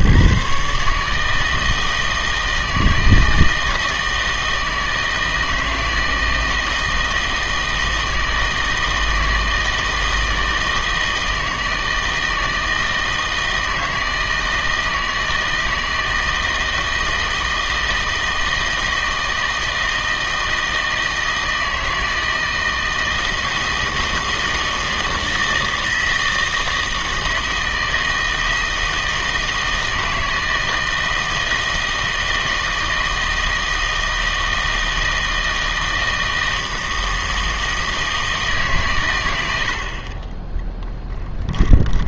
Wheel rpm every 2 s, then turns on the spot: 140, 160, 160, 160, 160, 160, 160, 160, 160, 160, 160, 160, 160, 160, 160, 160, 160, 160, 160, 150, 10.
none